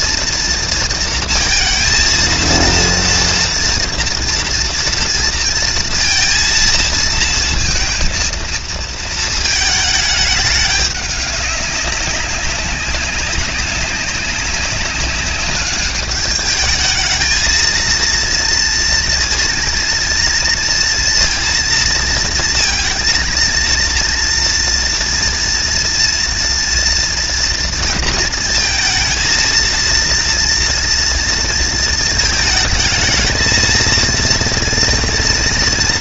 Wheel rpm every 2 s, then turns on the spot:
230, 230, 230, 230, 230, 200, 190, 200, 220, 230, 230, 230, 230, 230, 230, 230, 220, 230.
none